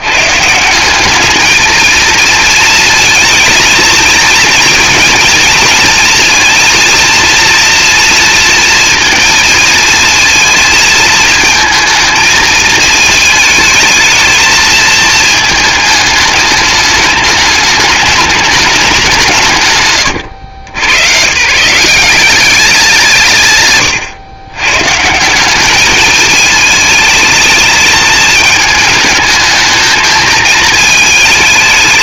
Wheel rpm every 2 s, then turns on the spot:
180, 230, 230, 230, 230, 220, 220, 230, 210, 200, 110, 190, 140, 220, 210, 220.
none